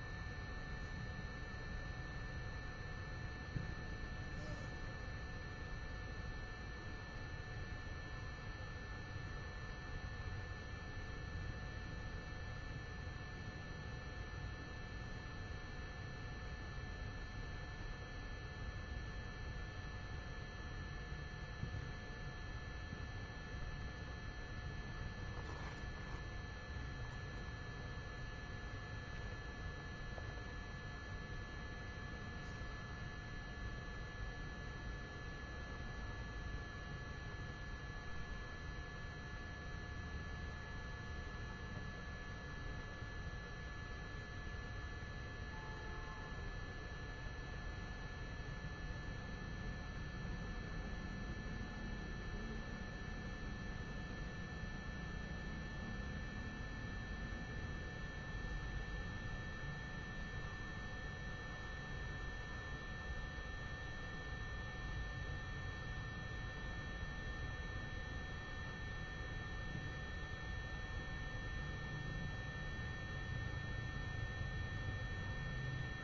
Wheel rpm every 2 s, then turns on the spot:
0, 0, 0, 0, 0, 0, 0, 0, 0, 0, 0, 0, 0, 0, 0, 0, 0, 0, 0, 0, 0, 0, 0, 0, 0, 0, 0, 0, 0, 0, 0, 0, 0, 0, 0, 0, 0, 0.
none